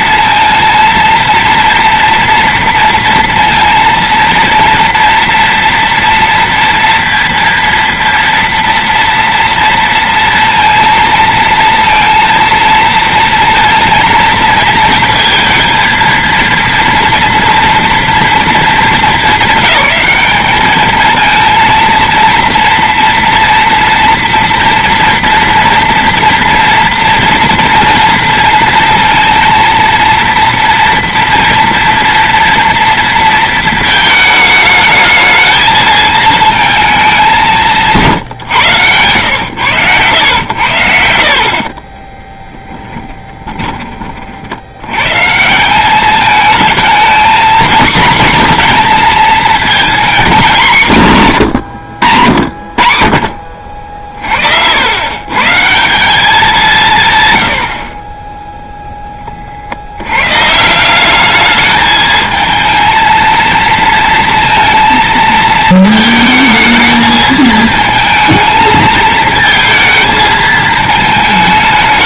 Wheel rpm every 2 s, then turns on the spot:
230, 230, 230, 230, 230, 230, 230, 230, 230, 220, 230, 240, 230, 230, 230, 230, 230, 220, 190, 110, 70, 20, 120, 220, 230, 170, 40, 90, 170, 0, 180, 230, 230, 220, 220, 220.
40-44